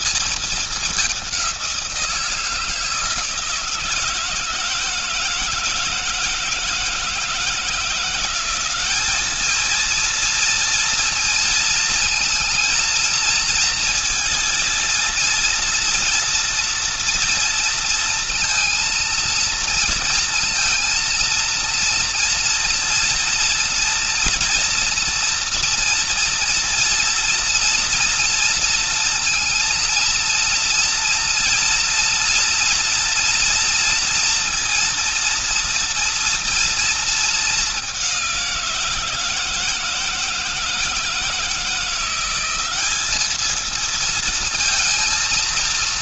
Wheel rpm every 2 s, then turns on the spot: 220, 170, 160, 160, 180, 230, 230, 230, 230, 230, 230, 230, 230, 230, 230, 230, 230, 230, 230, 190, 160, 180, 220.
none